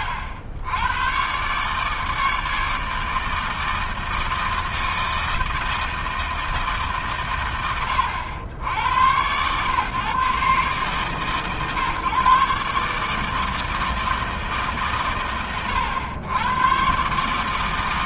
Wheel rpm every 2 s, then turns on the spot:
80, 160, 160, 130, 90, 130, 140, 120, 100.
none